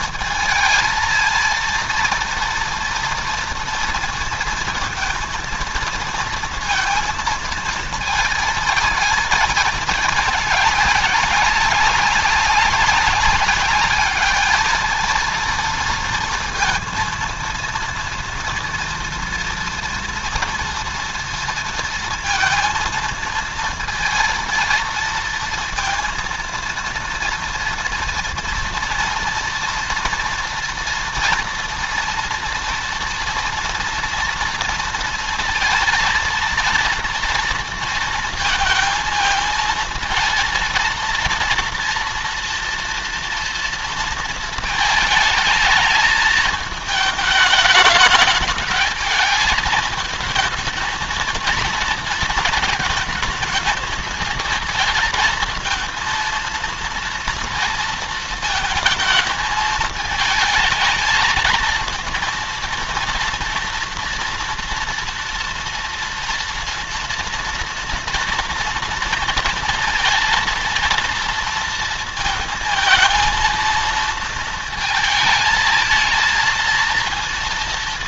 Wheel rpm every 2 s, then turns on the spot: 220, 230, 230, 230, 220, 200, 200, 220, 230, 230, 230, 230, 230, 230, 230, 240, 230, 230, 230, 220, 230, 240, 220, 220, 220, 230, 230, 230, 230, 220, 220, 230, 230, 230, 230, 230, 230, 220, 230.
none